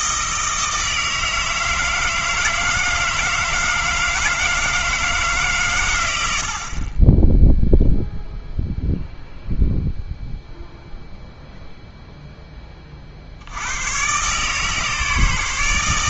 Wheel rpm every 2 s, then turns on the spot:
160, 160, 160, 40, 0, 0, 30, 150.
none